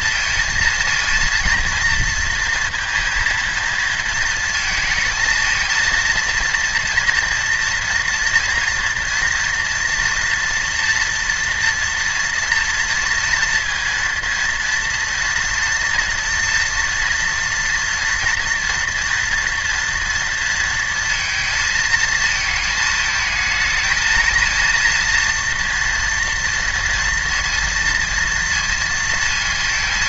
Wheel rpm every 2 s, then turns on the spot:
230, 230, 220, 230, 230, 230, 230, 230, 230, 230, 230, 220, 230, 230, 230.
none